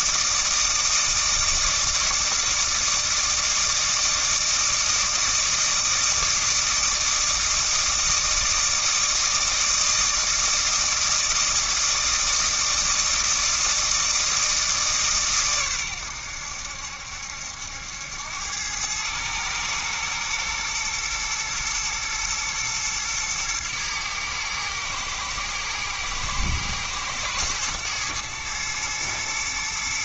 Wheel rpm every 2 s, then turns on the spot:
160, 160, 160, 160, 160, 160, 160, 160, 80, 100, 110, 110, 110, 110, 110.
none